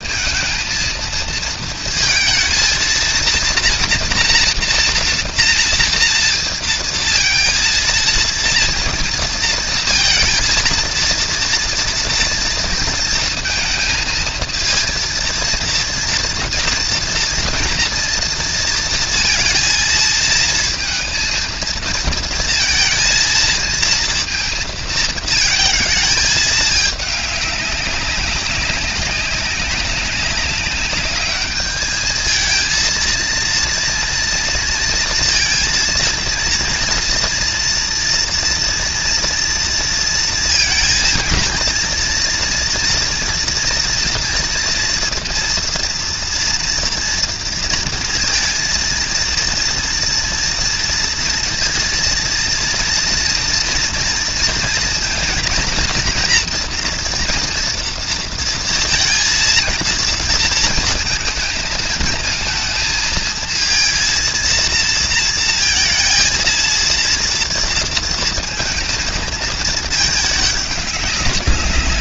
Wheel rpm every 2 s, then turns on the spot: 230, 230, 230, 230, 230, 230, 230, 230, 230, 230, 220, 230, 230, 210, 200, 200, 220, 230, 230, 230, 230, 230, 240, 240, 230, 230, 230, 230, 230, 230, 230, 230, 230, 230, 230, 210.
none